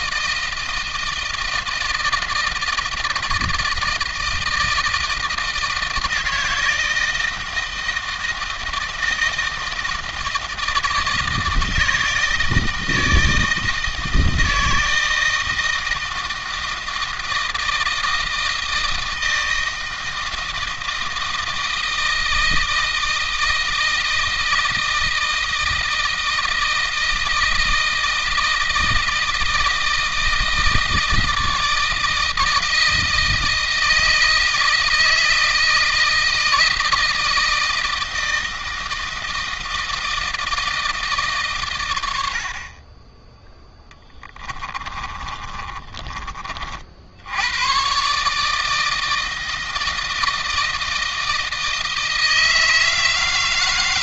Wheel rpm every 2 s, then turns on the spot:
160, 160, 160, 160, 160, 160, 160, 160, 160, 160, 160, 160, 160, 160, 160, 160, 160, 160, 160, 160, 160, 40, 20, 50, 160, 160, 160.
44-46